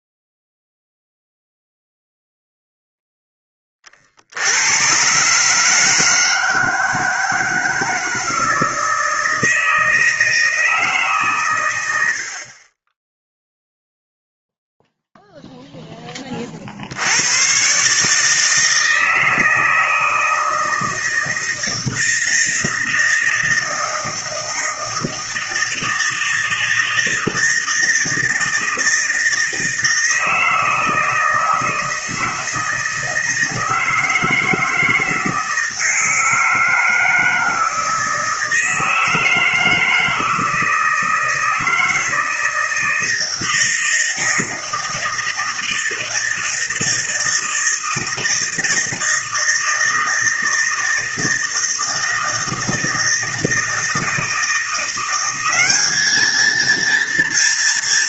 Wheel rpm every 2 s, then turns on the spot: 0, 0, 100, 160, 160, 160, 40, 0, 50, 160, 160, 160, 160, 160, 160, 160, 160, 160, 160, 160, 160, 160, 160, 160, 160, 160, 160, 170, 220.
none